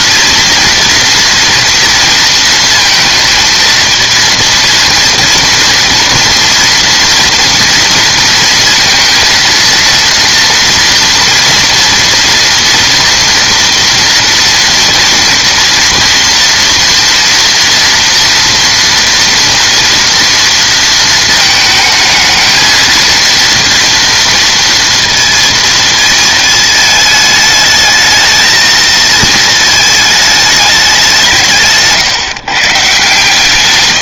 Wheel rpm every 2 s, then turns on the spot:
230, 230, 230, 230, 230, 230, 230, 230, 240, 230, 230, 220, 230, 220, 220, 210, 150.
none